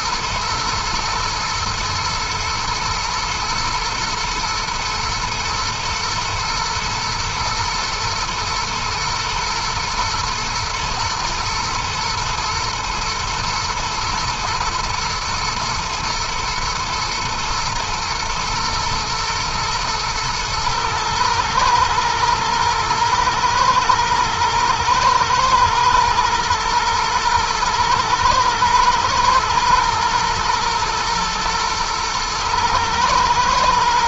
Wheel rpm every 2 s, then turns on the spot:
120, 120, 120, 120, 120, 110, 110, 110, 110, 110, 110, 110, 120, 110, 120, 120, 120.
none